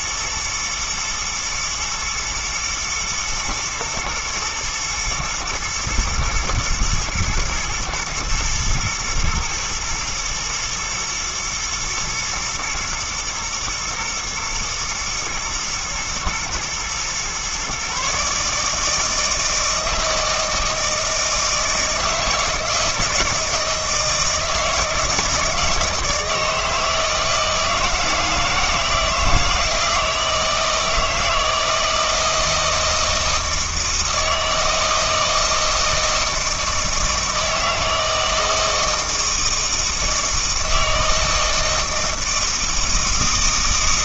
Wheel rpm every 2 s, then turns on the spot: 120, 120, 120, 120, 120, 120, 110, 120, 120, 160, 160, 160, 160, 160, 160, 160, 160, 160, 160, 160, 160, 160.
none